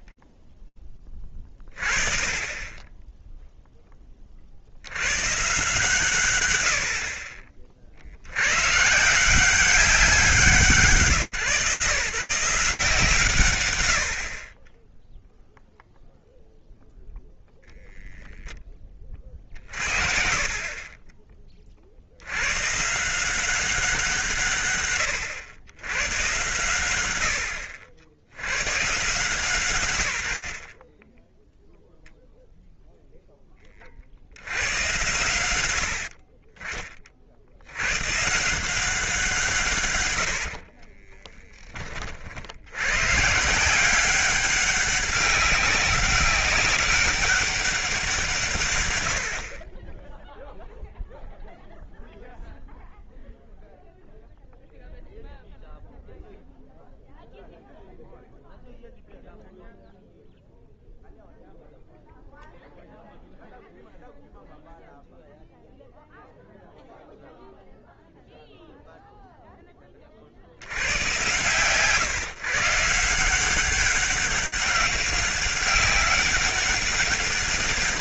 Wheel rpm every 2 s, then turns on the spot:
20, 10, 90, 60, 160, 140, 150, 10, 0, 30, 30, 170, 110, 80, 140, 10, 10, 70, 50, 170, 20, 150, 200, 200, 50, 0, 0, 0, 0, 0, 0, 0, 0, 0, 0, 110, 160, 200, 200.
40-42